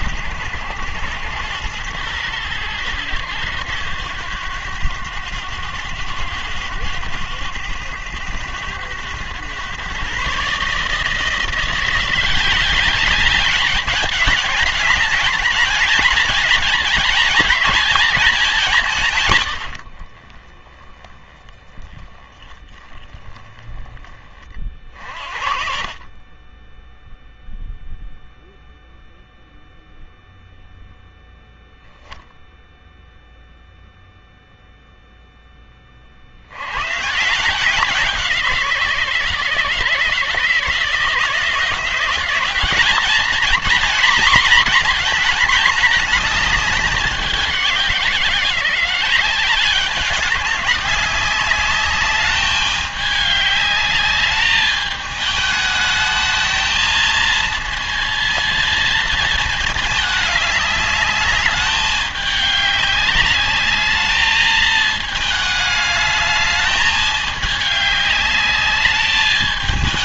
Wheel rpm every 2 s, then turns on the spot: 100, 100, 100, 100, 100, 160, 200, 210, 220, 170, 10, 10, 50, 0, 0, 0, 0, 0, 120, 160, 160, 210, 240, 200, 180, 190, 210, 210, 220, 220, 210, 200, 220, 210, 210.
none